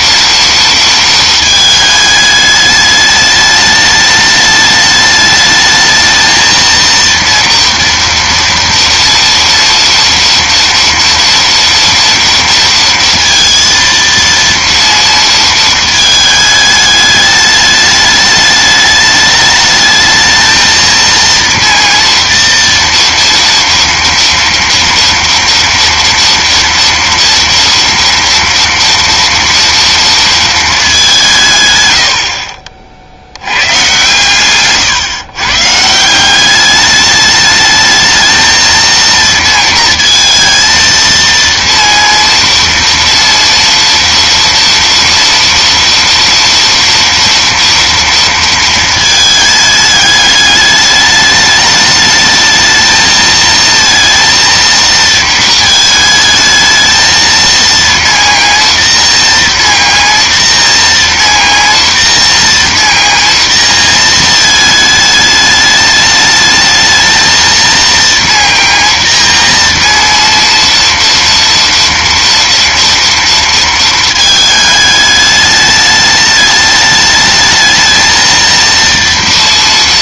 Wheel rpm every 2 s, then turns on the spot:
230, 210, 210, 230, 230, 230, 230, 230, 210, 210, 230, 230, 230, 230, 230, 220, 50, 130, 200, 220, 230, 230, 230, 230, 230, 210, 220, 230, 220, 230, 230, 230, 220, 220, 230, 230, 230, 210, 210, 230.
none